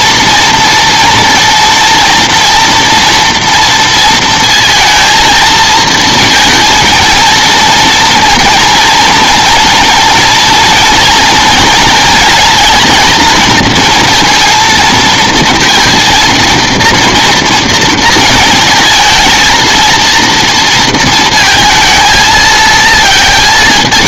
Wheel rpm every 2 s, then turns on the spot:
230, 230, 230, 230, 230, 230, 230, 230, 230, 220, 230, 230.
none